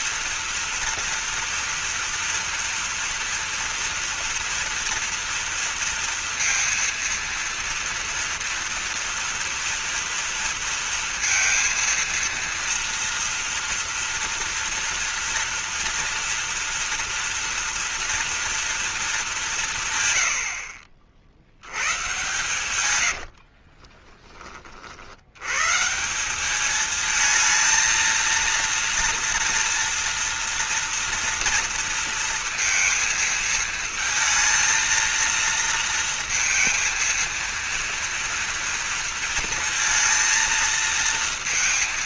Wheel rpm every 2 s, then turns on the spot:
230, 230, 230, 230, 230, 230, 230, 230, 230, 230, 60, 110, 40, 210, 230, 230, 230, 220, 230, 230, 230.
22-24